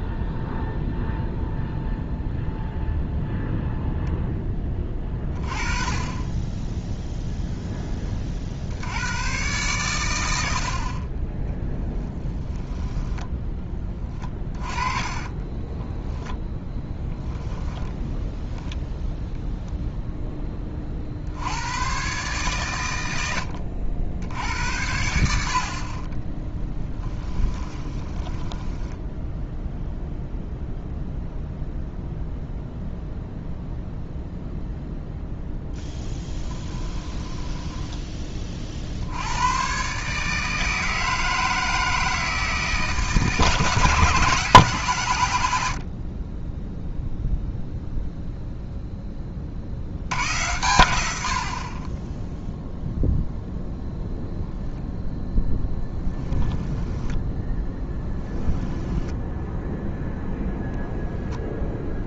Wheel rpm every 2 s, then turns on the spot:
0, 0, 20, 10, 80, 50, 10, 20, 10, 10, 40, 110, 70, 20, 10, 0, 0, 0, 10, 50, 160, 160, 140, 10, 0, 90, 0, 0, 10, 10, 0.
14-16 26-30 36-38 58-60